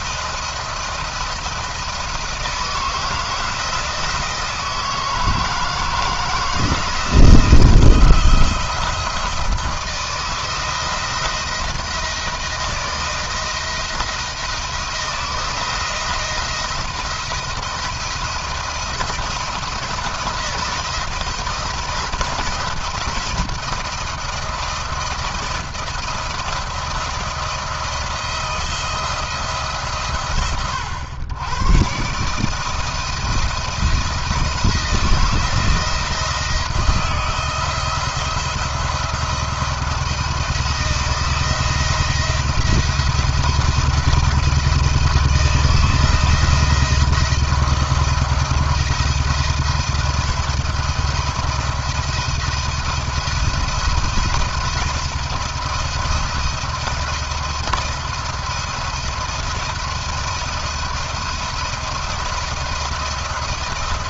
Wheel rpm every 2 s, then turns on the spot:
170, 160, 160, 160, 170, 170, 170, 170, 170, 170, 170, 170, 170, 160, 160, 120, 160, 170, 170, 170, 160, 170, 160, 160, 170, 170, 160, 170, 170, 170, 170, 170.
none